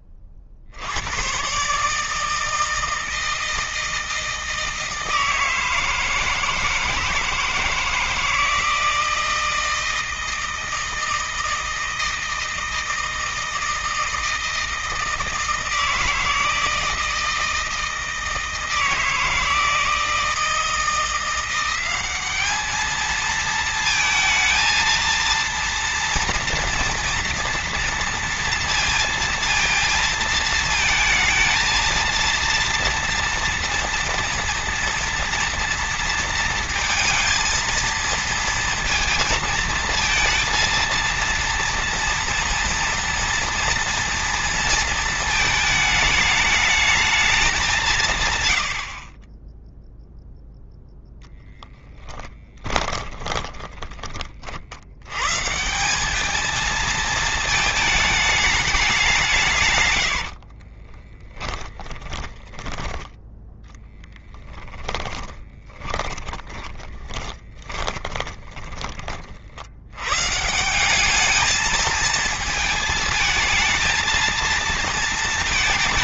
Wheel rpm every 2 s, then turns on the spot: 130, 160, 160, 160, 160, 160, 160, 160, 160, 160, 180, 220, 230, 230, 230, 220, 230, 230, 230, 230, 230, 230, 220, 210, 60, 0, 20, 70, 220, 200, 40, 20, 10, 20, 20, 180, 220, 230.
52-54 60-68